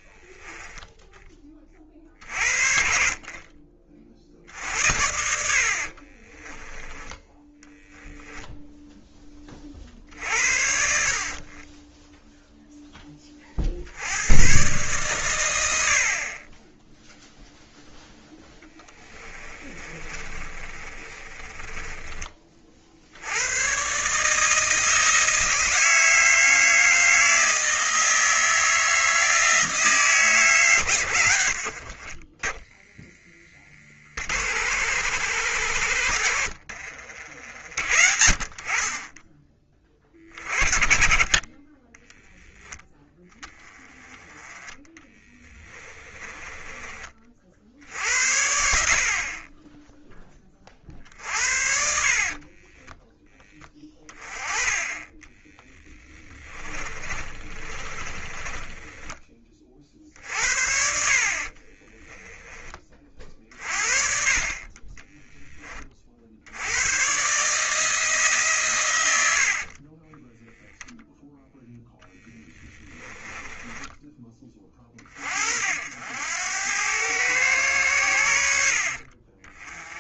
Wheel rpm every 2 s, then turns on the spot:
10, 50, 70, 10, 0, 60, 10, 140, 10, 10, 30, 50, 160, 160, 160, 120, 10, 90, 60, 30, 30, 10, 10, 20, 60, 40, 20, 20, 20, 20, 60, 40, 20, 110, 120, 0, 20, 30, 100, 50.
4-6 18-22 36-38 44-46 52-54 56-60 72-74 78-80